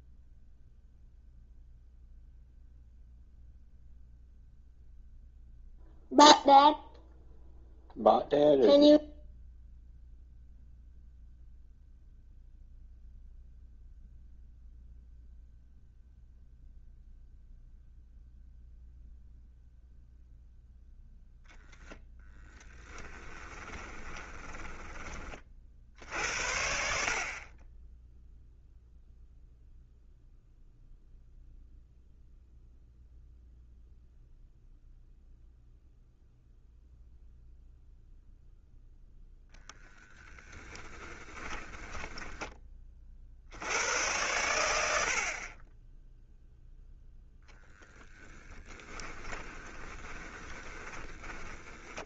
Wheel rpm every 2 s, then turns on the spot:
0, 0, 0, 0, 0, 0, 0, 0, 0, 0, 0, 10, 20, 50, 0, 0, 0, 0, 0, 0, 10, 30, 90, 0, 20, 20.
22-24 40-42 48-52